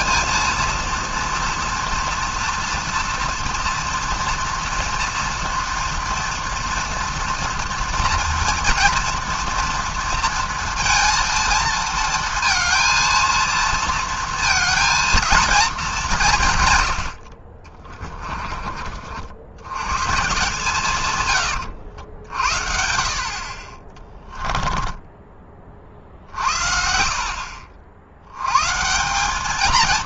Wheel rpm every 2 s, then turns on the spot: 230, 230, 230, 230, 230, 230, 230, 230, 130, 30, 150, 70, 20, 50, 120.
18-20 24-26